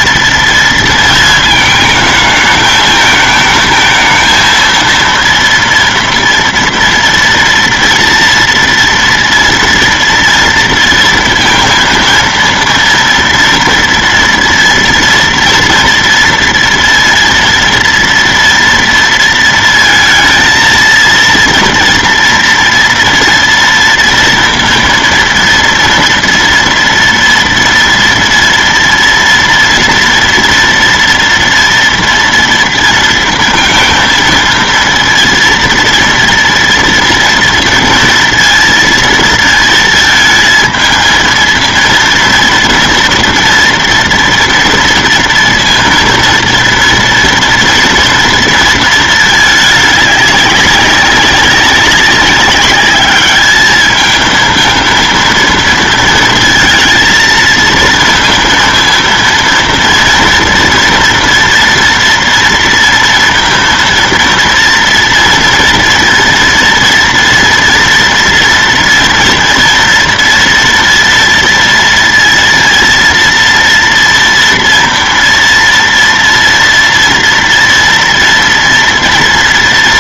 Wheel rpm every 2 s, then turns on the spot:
230, 220, 230, 230, 230, 230, 230, 230, 230, 230, 230, 240, 230, 230, 240, 230, 230, 230, 230, 230, 220, 230, 230, 230, 230, 200, 200, 230, 230, 230, 230, 230, 230, 230, 240, 230, 230, 230, 230, 230.
none